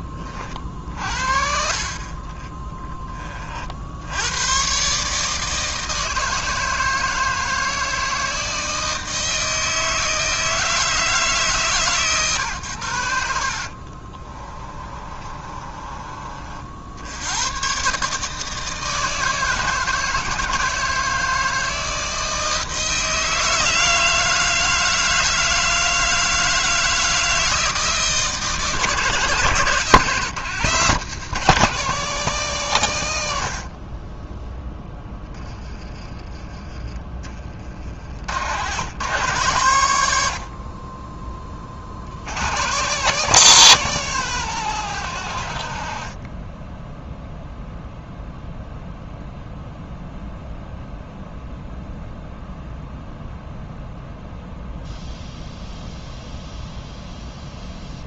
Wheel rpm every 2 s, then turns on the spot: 50, 10, 130, 160, 160, 160, 110, 30, 60, 160, 160, 160, 160, 160, 140, 160, 130, 10, 30, 120, 40, 140, 130, 10, 0, 0, 0, 0, 0.
14-16